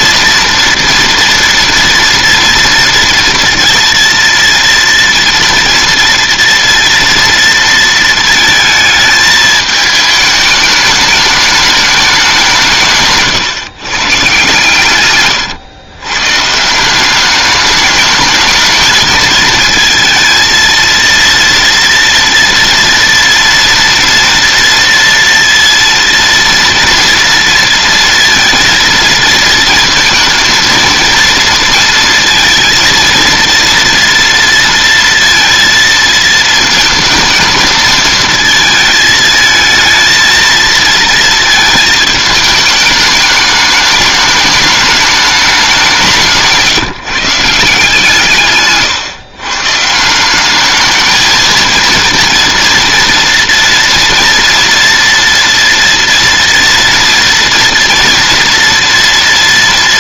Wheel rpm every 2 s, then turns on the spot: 240, 230, 230, 230, 220, 210, 170, 130, 150, 220, 230, 230, 230, 230, 230, 230, 230, 230, 220, 220, 230, 210, 210, 170, 130, 200, 230, 230, 230, 230.
none